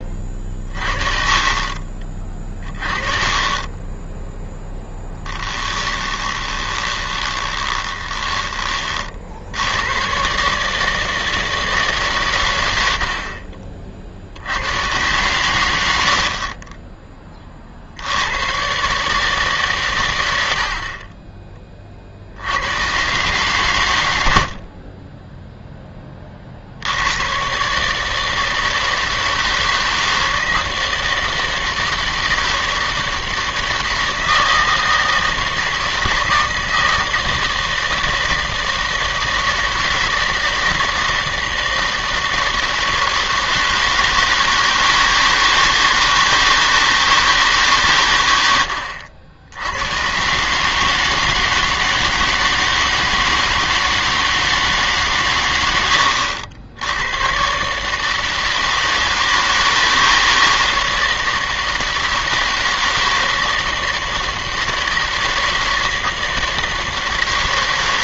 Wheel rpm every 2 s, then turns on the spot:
30, 20, 0, 20, 20, 150, 90, 90, 30, 120, 70, 90, 50, 50, 160, 160, 160, 160, 160, 160, 160, 160, 160, 160, 90, 150, 160, 160, 80, 160, 160, 160, 160, 160.
6-10